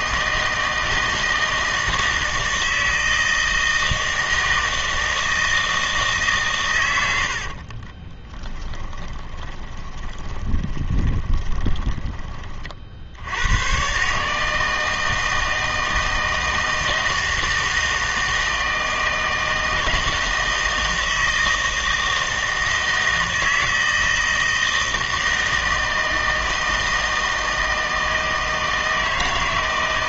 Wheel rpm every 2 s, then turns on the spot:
160, 160, 160, 120, 20, 20, 40, 160, 160, 160, 160, 160, 160, 160, 160.
8-12